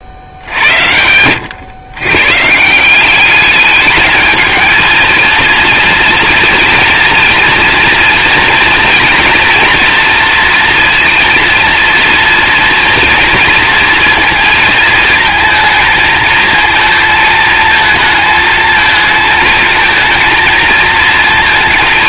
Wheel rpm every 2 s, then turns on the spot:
80, 180, 220, 230, 240, 230, 230, 220, 230, 220, 230.
0-2